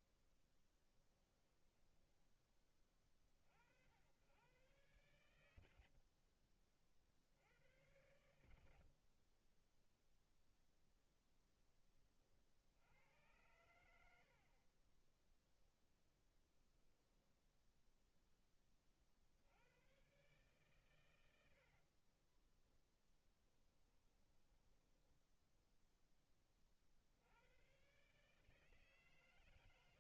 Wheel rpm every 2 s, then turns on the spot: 10, 40, 100, 50, 40, 10, 70, 20, 10, 60, 110, 10, 10, 70, 140.
0-2 14-18 20-26